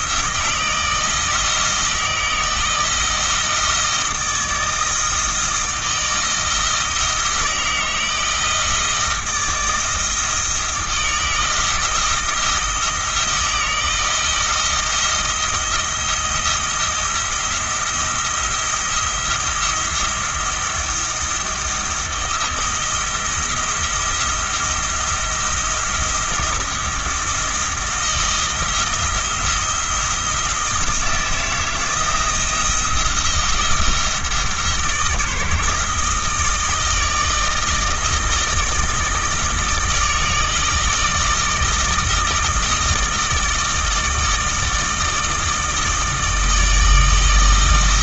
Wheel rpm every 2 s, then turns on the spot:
160, 160, 160, 160, 160, 160, 160, 170, 170, 170, 170, 170, 170, 170, 160, 160, 170, 160, 160, 160, 160, 160, 160, 160.
none